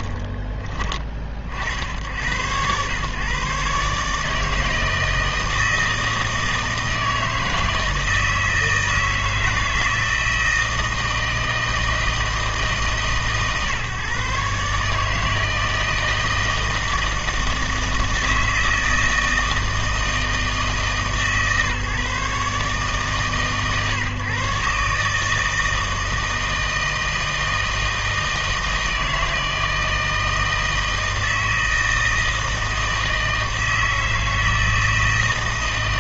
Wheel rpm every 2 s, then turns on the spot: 10, 90, 160, 160, 160, 160, 160, 140, 160, 160, 160, 150, 140, 160, 160, 160, 160, 160.
none